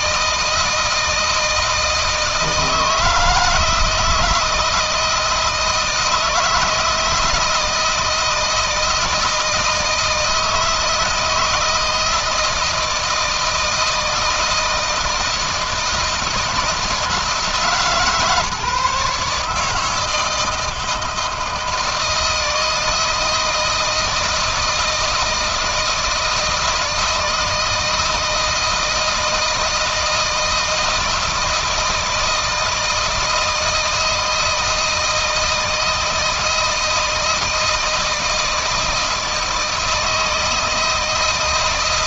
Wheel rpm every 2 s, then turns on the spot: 170, 160, 160, 160, 160, 160, 160, 160, 160, 150, 160, 160, 160, 160, 160, 160, 160, 160, 160, 160, 160.
none